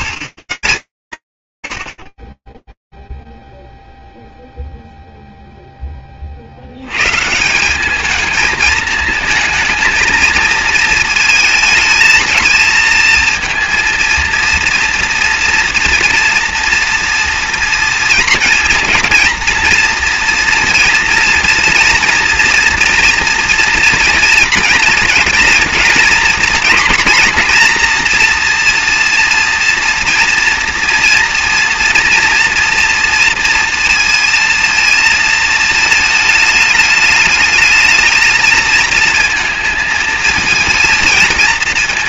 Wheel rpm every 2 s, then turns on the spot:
120, 30, 0, 70, 220, 220, 220, 230, 230, 230, 230, 230, 230, 240, 230, 230, 230, 230, 210, 220, 230.
none